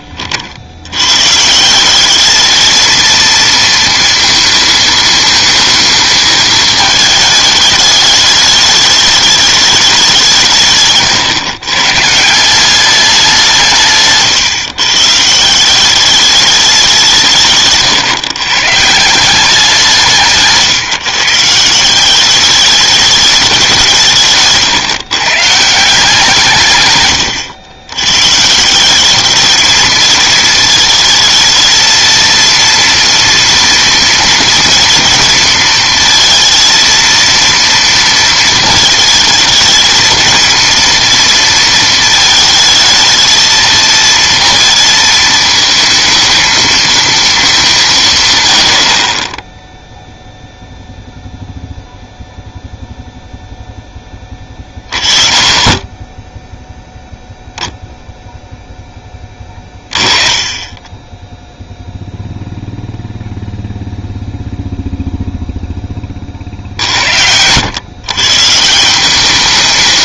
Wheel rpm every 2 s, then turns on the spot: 70, 210, 230, 220, 210, 150, 180, 130, 200, 140, 160, 200, 150, 150, 160, 220, 230, 230, 230, 220, 230, 220, 230, 220, 100, 0, 0, 20, 0, 0, 20, 0, 0, 50, 160.
none